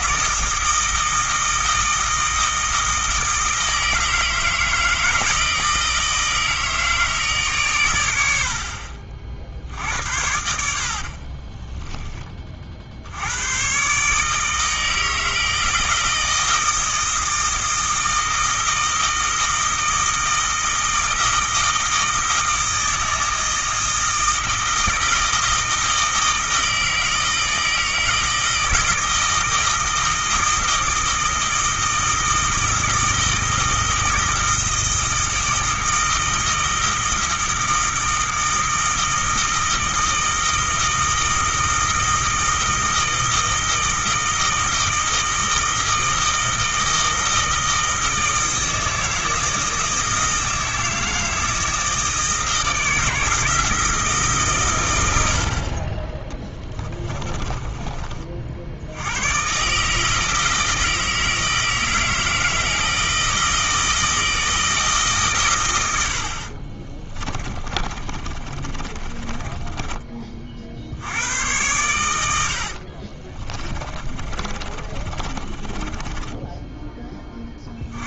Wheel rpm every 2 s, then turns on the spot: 160, 160, 160, 160, 60, 60, 60, 160, 160, 160, 160, 160, 160, 160, 160, 160, 160, 160, 160, 160, 160, 160, 160, 160, 160, 160, 160, 110, 20, 80, 160, 160, 150, 30, 30, 60, 60, 30, 10.
10-12 56-58 66-70 72-76